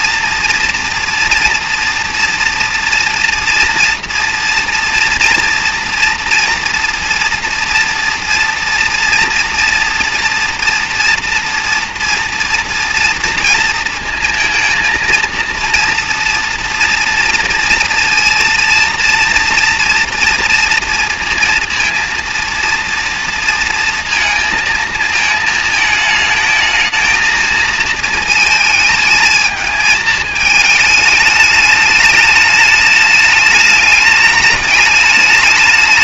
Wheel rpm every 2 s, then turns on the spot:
240, 230, 230, 230, 230, 240, 230, 230, 230, 230, 230, 230, 220, 230, 220, 210, 210, 210.
none